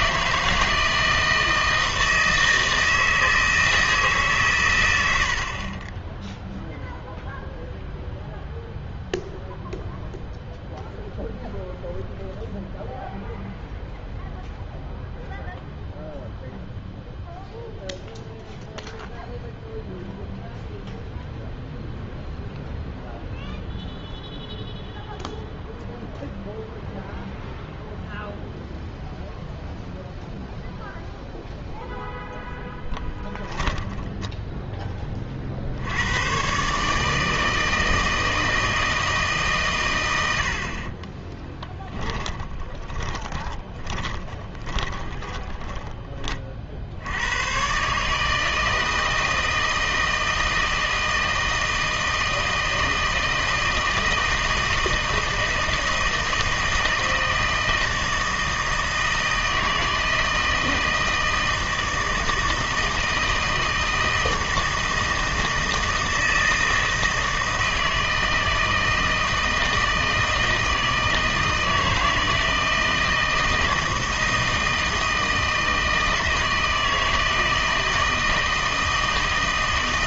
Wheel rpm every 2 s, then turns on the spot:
160, 160, 100, 0, 0, 0, 0, 0, 0, 0, 0, 0, 0, 0, 0, 0, 10, 10, 140, 160, 30, 20, 10, 60, 160, 160, 160, 160, 160, 160, 160, 160, 160, 160, 160, 160, 160, 160, 160, 160.
40-46